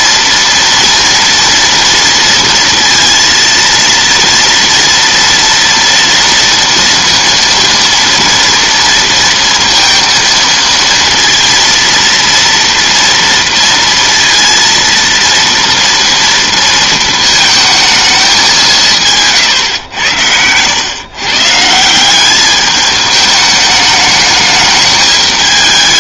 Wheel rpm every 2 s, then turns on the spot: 230, 230, 230, 230, 230, 230, 230, 230, 230, 180, 120, 210, 210.
none